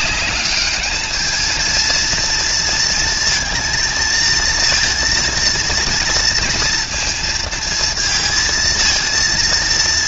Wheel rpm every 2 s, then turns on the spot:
210, 230, 230, 230, 230.
none